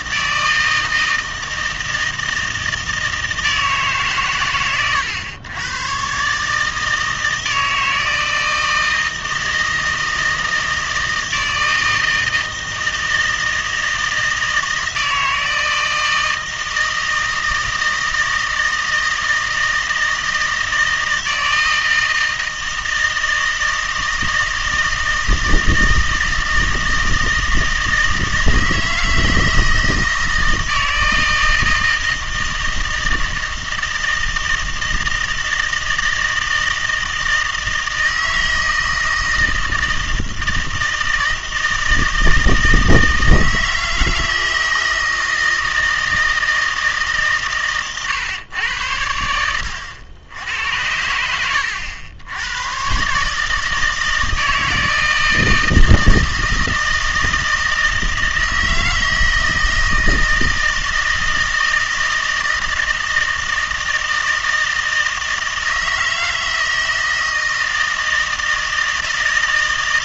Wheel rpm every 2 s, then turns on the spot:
160, 160, 110, 150, 160, 160, 160, 160, 160, 160, 160, 160, 160, 160, 160, 160, 160, 160, 160, 160, 160, 160, 160, 160, 100, 90, 110, 160, 160, 160, 160, 160, 160, 160, 160.
none